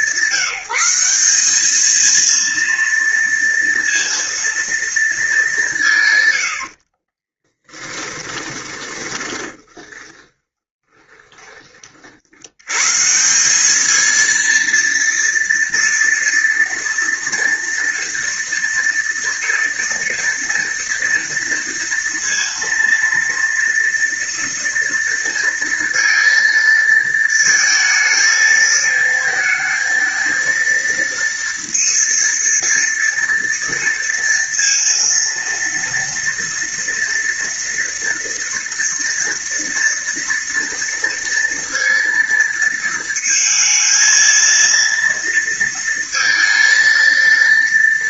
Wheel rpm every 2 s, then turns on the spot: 190, 230, 230, 50, 20, 20, 140, 230, 230, 230, 230, 230, 230, 230, 220, 230, 230, 230, 230, 230, 230, 230, 230, 230.
6-12